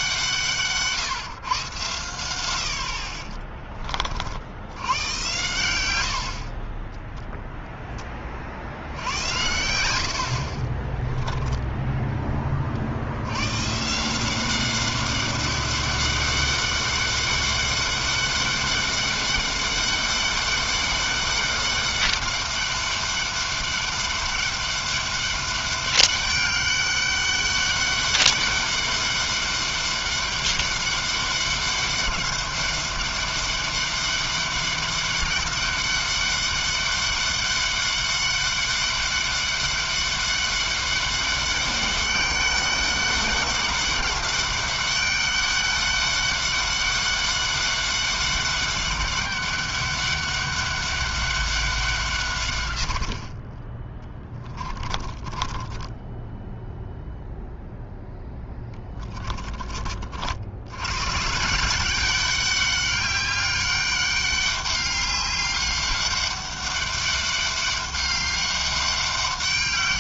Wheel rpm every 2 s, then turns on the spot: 150, 80, 70, 40, 50, 40, 20, 180, 200, 200, 200, 200, 200, 200, 200, 200, 200, 200, 200, 200, 200, 200, 200, 200, 200, 200, 110, 20, 10, 20, 70, 200, 200, 200, 200.
54-60